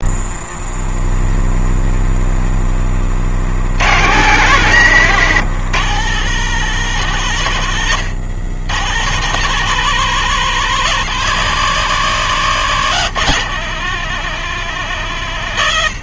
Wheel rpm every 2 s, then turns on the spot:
0, 30, 150, 150, 160, 180, 170, 160.
none